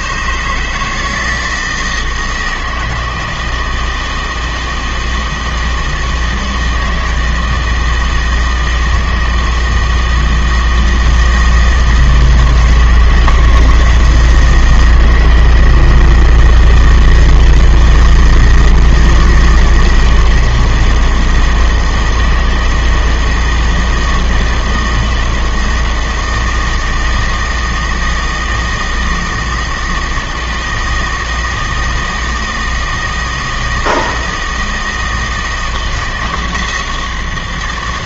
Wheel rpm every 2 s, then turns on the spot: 150, 160, 160, 160, 160, 160, 160, 160, 160, 160, 160, 160, 160, 160, 160, 160, 160, 160, 160.
none